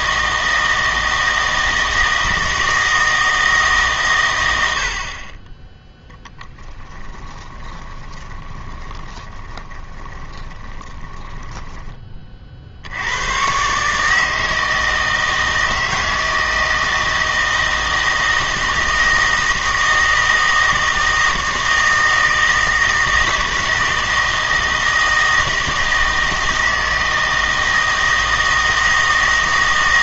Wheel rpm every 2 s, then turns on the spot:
160, 160, 80, 10, 20, 20, 70, 160, 160, 160, 160, 160, 160, 160, 160.
6-12